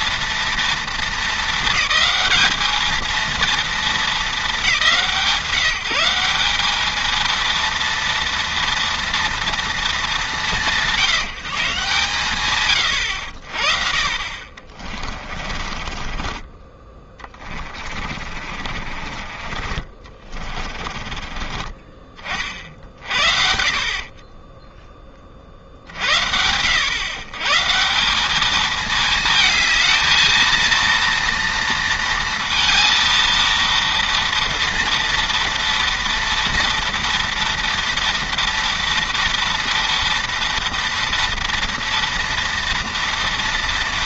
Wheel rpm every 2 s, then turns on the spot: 230, 210, 170, 210, 230, 160, 120, 30, 30, 40, 30, 50, 10, 110, 220, 230, 230, 230, 240, 230, 230, 230.
14-16 18-22